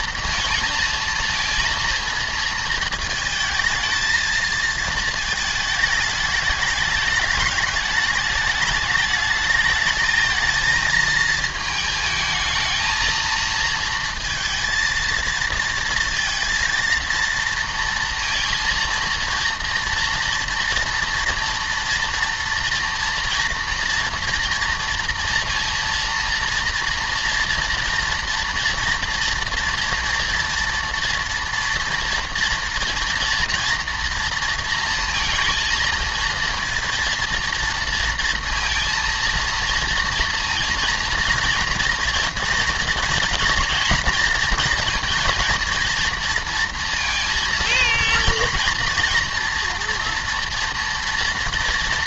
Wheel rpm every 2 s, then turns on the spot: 230, 230, 220, 210, 210, 220, 220, 230, 230, 230, 230, 240, 230, 230, 230, 230, 230, 230, 230, 230, 230, 230, 230, 230, 230, 230.
none